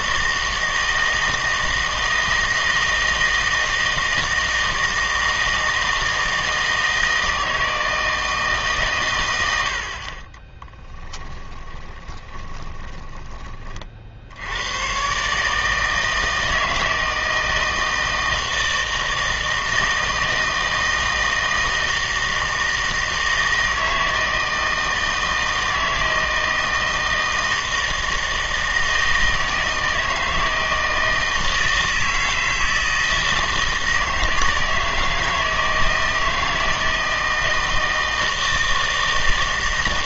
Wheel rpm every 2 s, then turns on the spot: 160, 160, 160, 160, 130, 10, 20, 110, 160, 160, 160, 160, 160, 160, 160, 160, 160, 160, 160, 160.
10-14